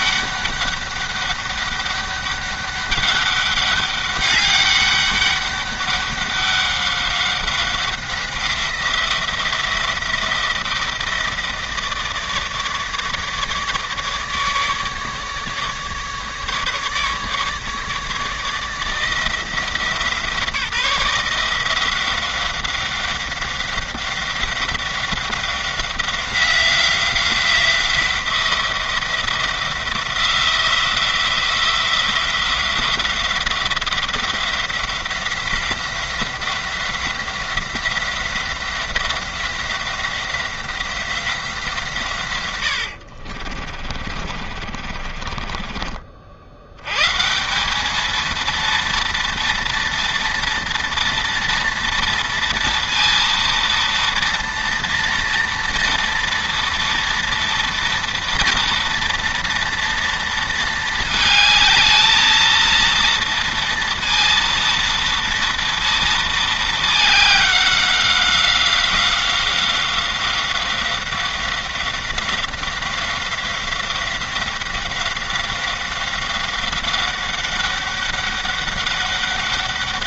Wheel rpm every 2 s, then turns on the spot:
200, 200, 200, 190, 180, 170, 150, 150, 150, 160, 160, 180, 190, 180, 170, 170, 180, 180, 180, 180, 180, 80, 50, 100, 230, 230, 230, 230, 230, 230, 220, 230, 230, 220, 190, 180, 190, 180, 190, 200.
42-46